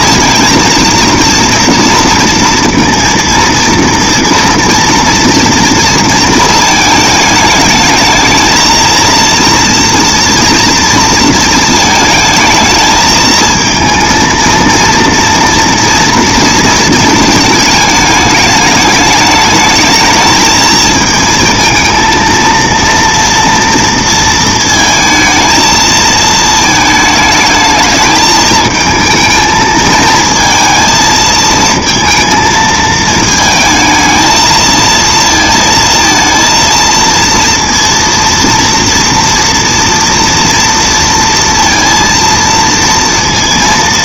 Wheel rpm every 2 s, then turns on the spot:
230, 230, 230, 220, 230, 220, 230, 230, 210, 220, 230, 230, 220, 220, 220, 230, 220, 230, 230, 230, 230, 230.
none